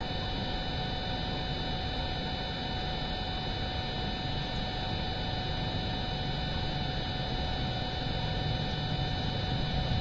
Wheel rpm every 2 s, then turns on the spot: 0, 0, 0, 0, 0.
none